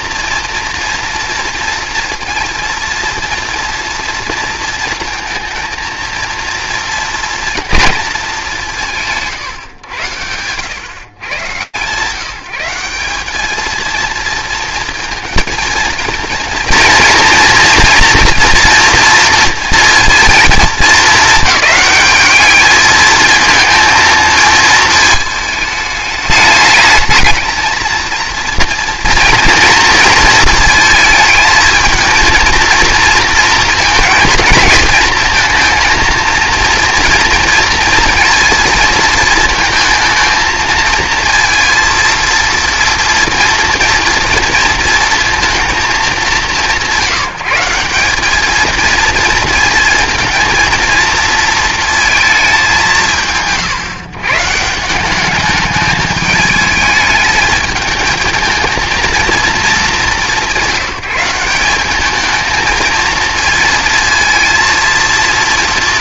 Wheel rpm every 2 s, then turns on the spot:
230, 230, 230, 230, 190, 130, 170, 230, 230, 240, 230, 210, 220, 210, 230, 230, 230, 230, 230, 230, 230, 230, 230, 200, 200, 230, 220, 130, 210, 220, 200, 220, 230.
none